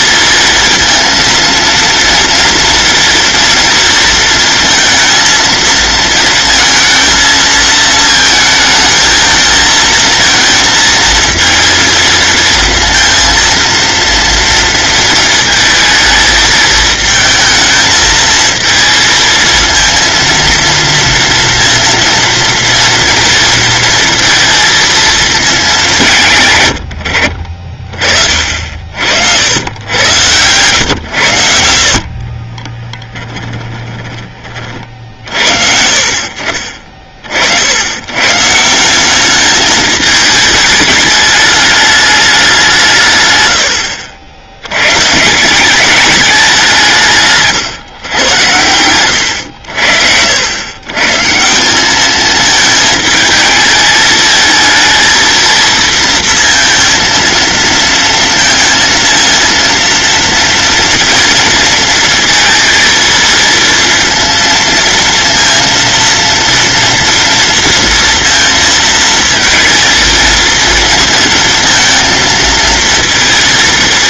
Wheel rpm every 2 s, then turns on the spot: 230, 230, 230, 220, 220, 230, 230, 230, 220, 220, 230, 230, 230, 100, 60, 110, 20, 40, 40, 180, 210, 170, 110, 170, 100, 110, 220, 220, 230, 230, 230, 220, 230, 230, 230, 230, 230.
32-34